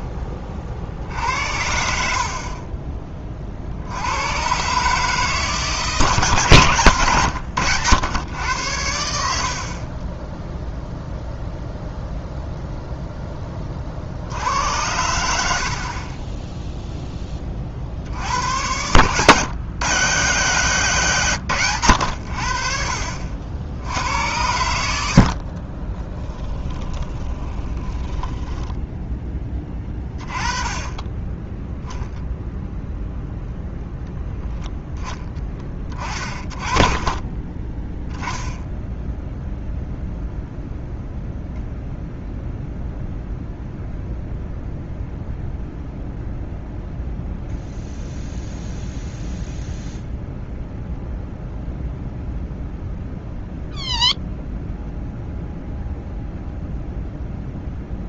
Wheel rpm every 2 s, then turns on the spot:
40, 30, 140, 130, 90, 0, 0, 90, 0, 100, 150, 50, 80, 10, 10, 20, 0, 0, 30, 0, 0, 0, 0, 0, 0, 0, 0, 0, 0.
2-4 26-30 36-38